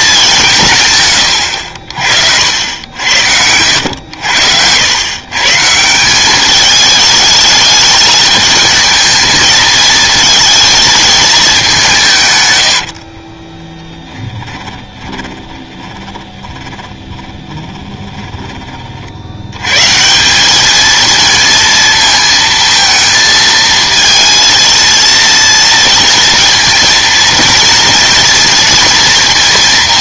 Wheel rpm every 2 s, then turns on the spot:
160, 70, 90, 210, 220, 220, 120, 30, 20, 30, 210, 230, 230, 230, 230.
12-18